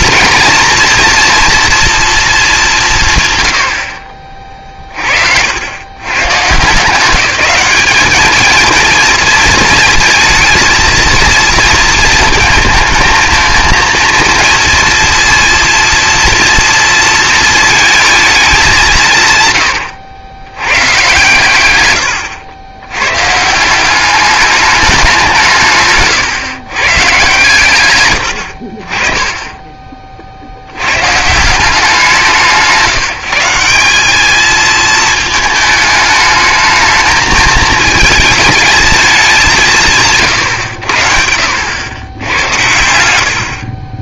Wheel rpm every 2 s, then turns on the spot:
230, 190, 40, 150, 230, 230, 220, 230, 240, 200, 120, 100, 210, 120, 60, 80, 170, 220, 220, 220, 90, 100.
none